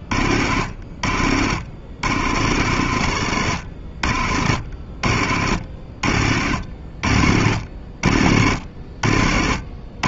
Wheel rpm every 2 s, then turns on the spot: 60, 90, 60, 60, 60.
none